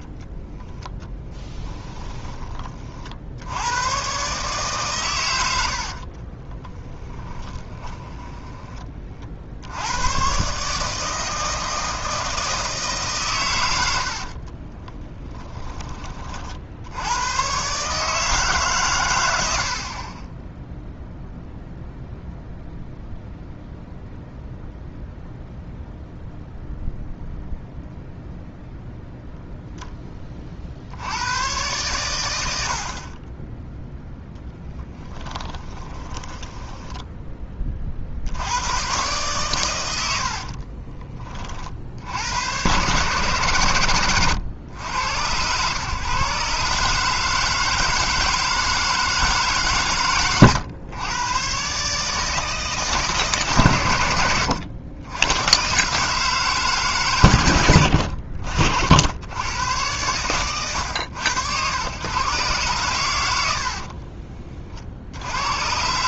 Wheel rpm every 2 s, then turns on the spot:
10, 40, 130, 20, 30, 150, 150, 20, 80, 130, 0, 0, 0, 0, 0, 60, 60, 10, 10, 110, 30, 130, 100, 150, 160, 110, 150, 90, 140, 70, 110, 120, 50.
6-8 14-16 34-38 40-42